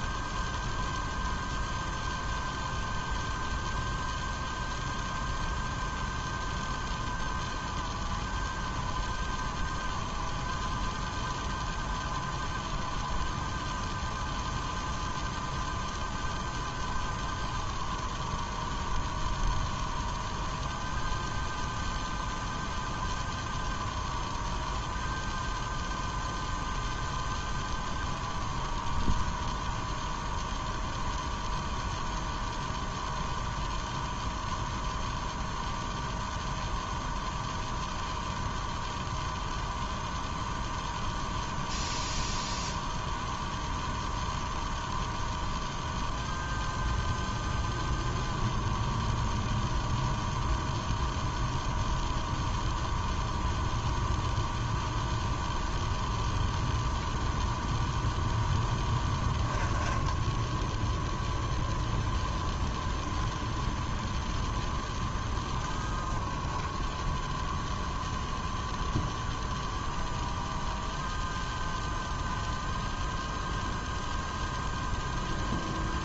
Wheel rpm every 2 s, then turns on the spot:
0, 0, 0, 0, 0, 0, 0, 0, 0, 0, 0, 0, 0, 0, 0, 0, 0, 0, 0, 0, 0, 0, 0, 0, 0, 0, 0, 0, 0, 0, 0, 0, 10, 10, 0, 0, 0, 0.
none